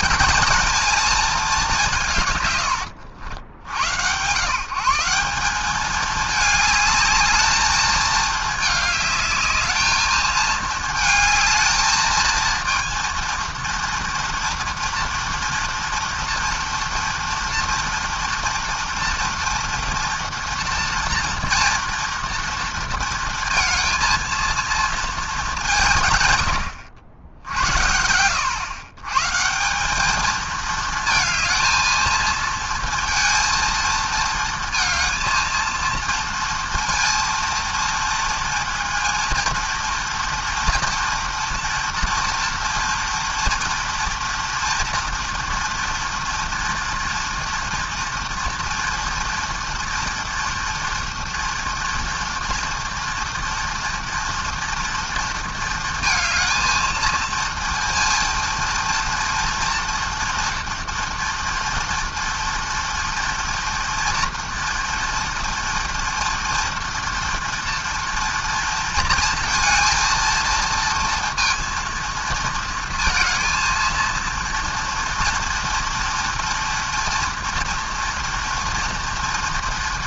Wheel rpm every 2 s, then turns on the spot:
220, 100, 170, 210, 210, 220, 230, 230, 230, 230, 230, 230, 220, 80, 120, 220, 230, 230, 230, 230, 240, 230, 230, 230, 230, 230, 230, 230, 230, 230, 230, 230, 230, 230, 230, 230, 230, 230, 230, 230.
none